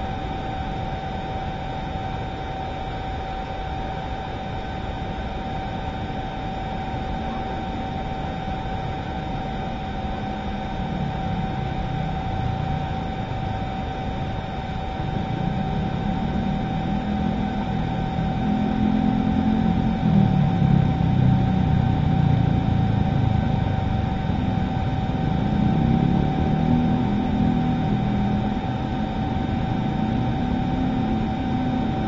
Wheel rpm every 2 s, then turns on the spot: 0, 0, 0, 0, 0, 0, 0, 0, 0, 0, 0, 0, 0, 0, 0, 0.
none